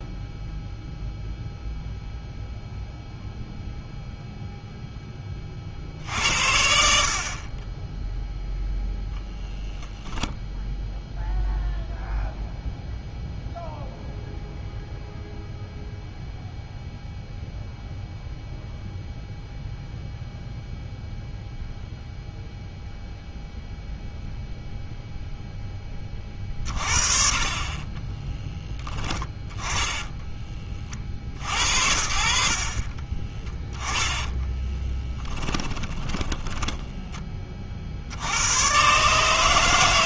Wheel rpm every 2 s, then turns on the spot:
0, 0, 0, 50, 0, 0, 0, 0, 0, 0, 0, 0, 0, 30, 10, 30, 40, 10, 10, 110.
34-36